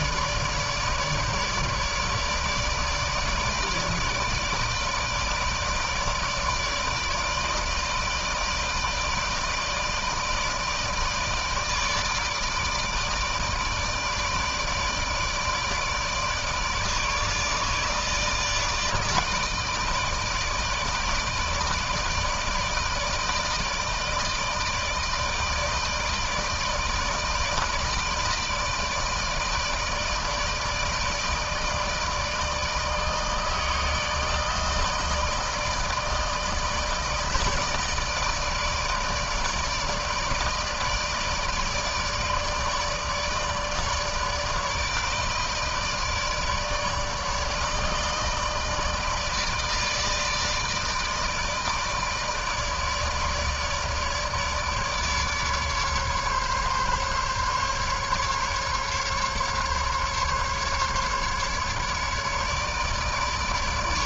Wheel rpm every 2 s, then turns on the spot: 150, 160, 160, 160, 160, 160, 150, 160, 150, 160, 160, 160, 160, 160, 160, 150, 160, 160, 160, 160, 160, 150, 160, 150, 150, 160, 160, 150, 140, 140, 150, 150.
none